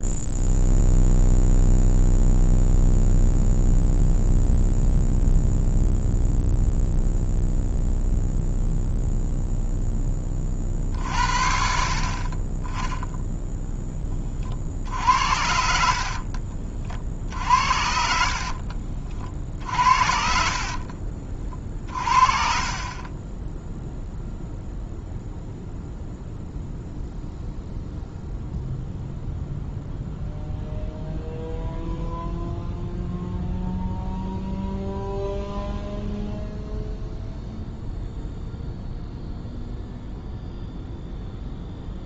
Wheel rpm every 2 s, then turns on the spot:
0, 0, 0, 0, 0, 30, 20, 60, 40, 40, 50, 40, 0, 0, 0, 0, 0, 0, 0, 0, 0.
18-22